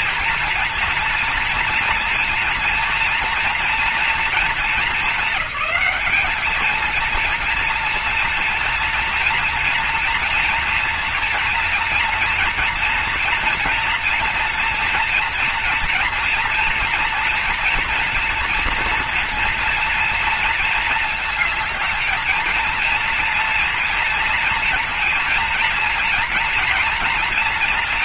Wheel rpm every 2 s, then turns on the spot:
230, 230, 220, 220, 230, 240, 230, 230, 230, 230, 230, 230, 230, 230.
none